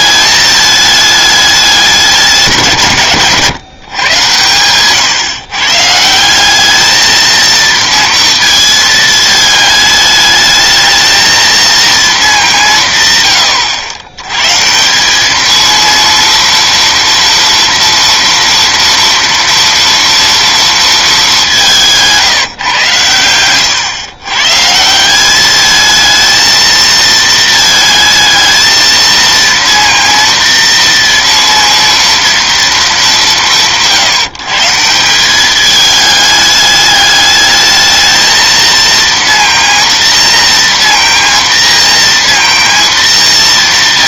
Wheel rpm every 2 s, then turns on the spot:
210, 160, 120, 190, 230, 220, 190, 140, 230, 230, 230, 150, 140, 220, 220, 230, 230, 160, 210, 230, 230, 230.
none